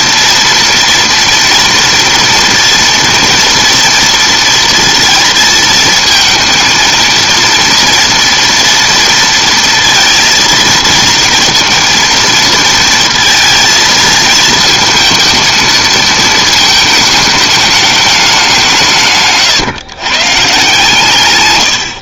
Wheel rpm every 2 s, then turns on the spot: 230, 230, 230, 230, 240, 230, 230, 220, 220, 190, 140.
none